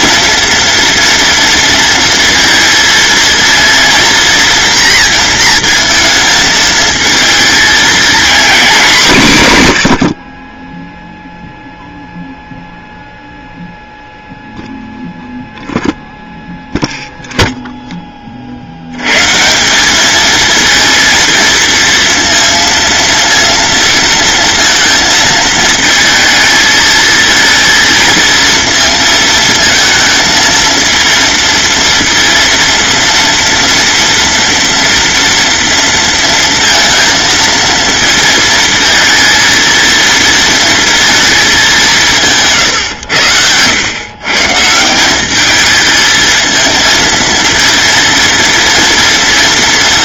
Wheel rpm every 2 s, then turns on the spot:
230, 230, 230, 220, 210, 0, 0, 0, 0, 110, 230, 230, 230, 220, 220, 230, 230, 230, 230, 220, 230, 120, 180, 230, 230.
none